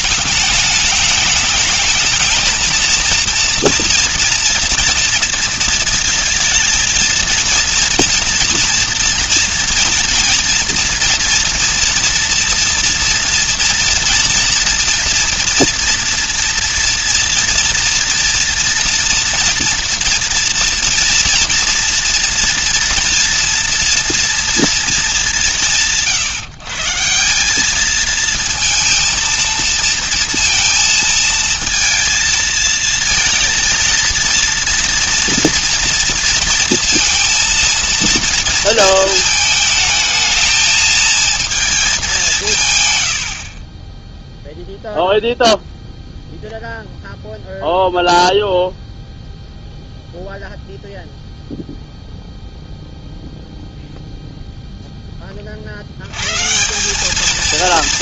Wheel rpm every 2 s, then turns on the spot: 210, 230, 230, 220, 230, 230, 240, 230, 230, 240, 240, 240, 230, 150, 230, 230, 230, 230, 230, 230, 220, 160, 0, 0, 0, 0, 0, 0, 140.
none